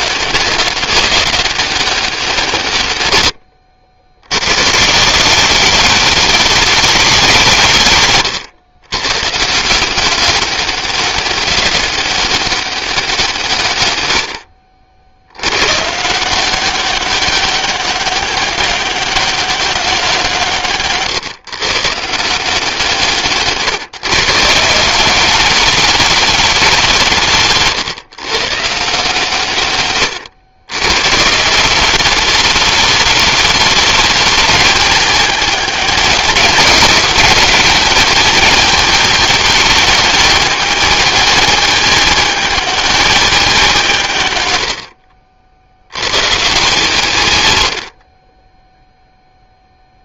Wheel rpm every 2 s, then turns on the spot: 200, 90, 190, 160, 150, 200, 140, 110, 190, 190, 140, 150, 210, 140, 120, 180, 210, 210, 210, 220, 210, 190, 70, 90, 0.
none